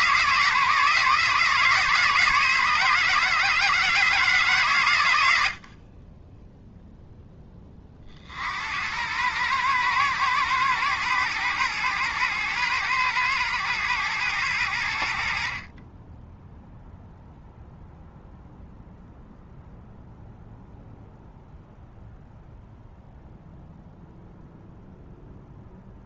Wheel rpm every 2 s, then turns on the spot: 160, 160, 130, 0, 80, 120, 110, 90, 0, 0, 0, 0, 0.
none